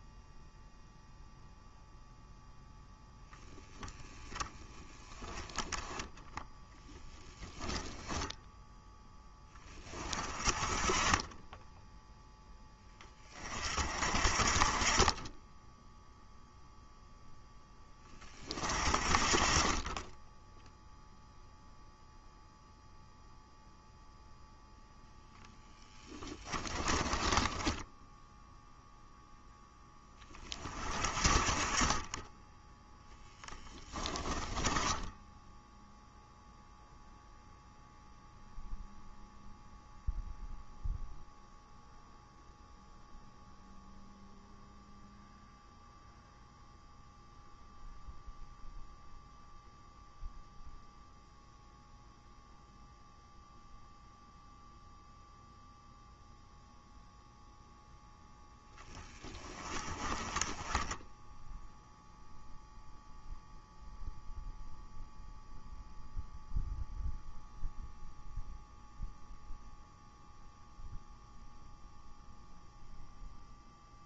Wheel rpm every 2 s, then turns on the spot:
0, 10, 30, 0, 10, 20, 20, 30, 0, 40, 0, 0, 0, 20, 0, 40, 10, 10, 0, 0, 0, 0, 0, 0, 0, 0, 0, 0, 0, 10, 10, 0, 0, 0, 0, 0, 0.
26-28 34-36